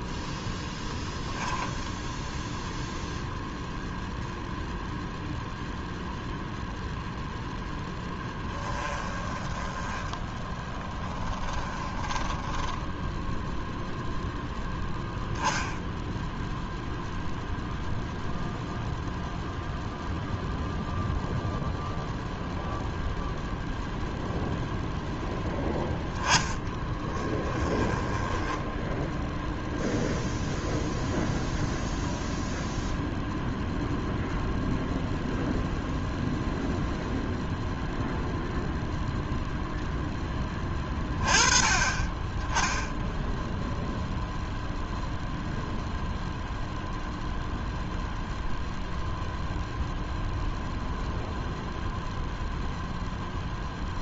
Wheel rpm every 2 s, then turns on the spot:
0, 0, 0, 0, 10, 10, 10, 0, 0, 0, 0, 0, 0, 10, 10, 0, 0, 0, 0, 0, 20, 10, 0, 0, 0, 0, 0.
8-12 26-30